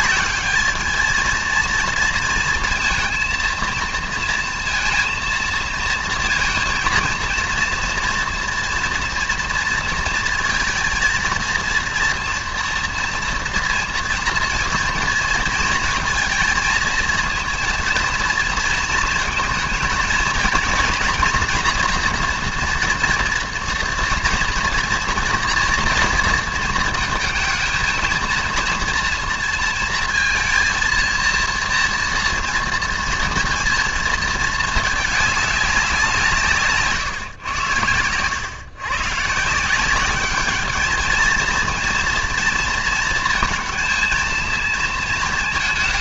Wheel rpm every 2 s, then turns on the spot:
210, 230, 230, 230, 230, 230, 230, 230, 220, 220, 230, 230, 230, 230, 230, 230, 230, 220, 160, 120, 210, 230, 230.
none